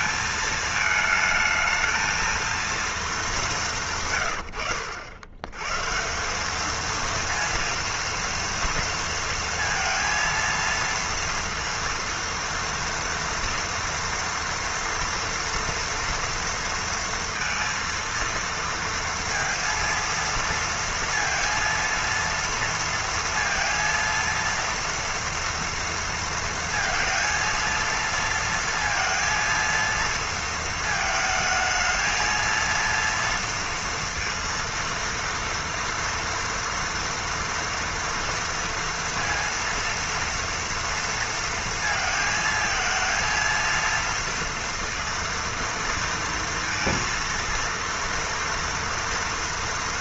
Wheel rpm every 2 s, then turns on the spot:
230, 230, 130, 170, 230, 230, 230, 230, 230, 230, 230, 230, 230, 230, 230, 230, 230, 230, 230, 230, 230, 220, 230, 230, 230.
none